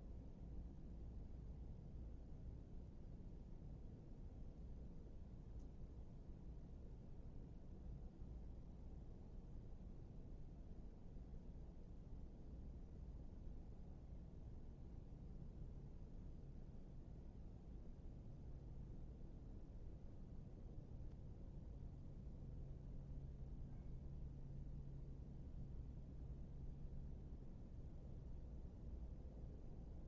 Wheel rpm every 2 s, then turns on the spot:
0, 0, 0, 0, 0, 0, 0, 0, 0, 0, 0, 0, 0, 0, 0.
none